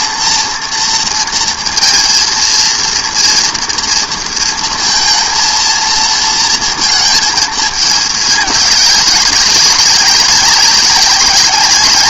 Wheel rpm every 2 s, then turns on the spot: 230, 230, 230, 230, 210, 190.
none